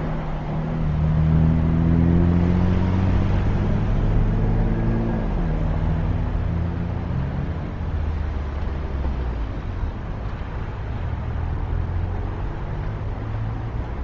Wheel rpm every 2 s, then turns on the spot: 0, 0, 0, 0, 0, 0, 0.
none